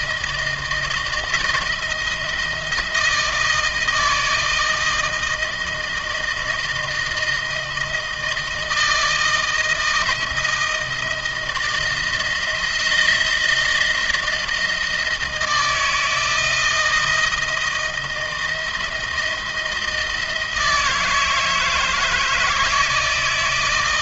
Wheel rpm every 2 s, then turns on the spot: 160, 160, 160, 160, 160, 160, 170, 160, 160, 160, 160, 160.
none